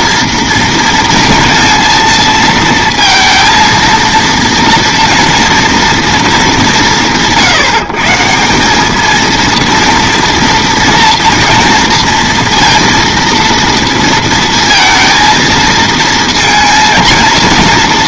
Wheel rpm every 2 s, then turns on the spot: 230, 230, 230, 180, 200, 230, 230, 230, 230.
none